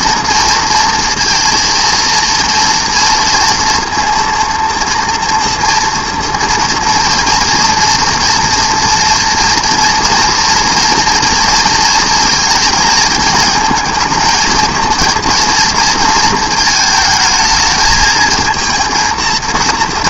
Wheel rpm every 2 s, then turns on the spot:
230, 230, 230, 240, 230, 230, 230, 230, 230, 230.
none